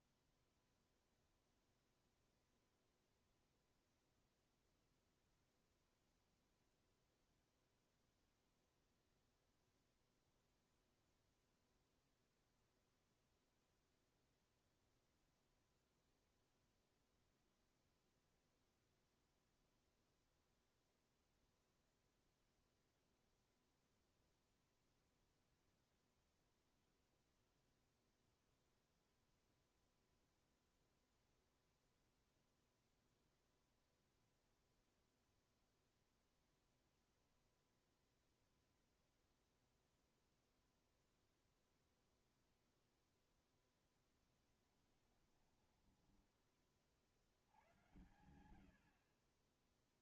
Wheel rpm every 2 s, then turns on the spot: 0, 0, 0, 0, 0, 0, 0, 0, 0, 0, 0, 0, 0, 0, 0, 0, 0, 0, 0, 0, 0, 0, 10, 30, 80.
44-46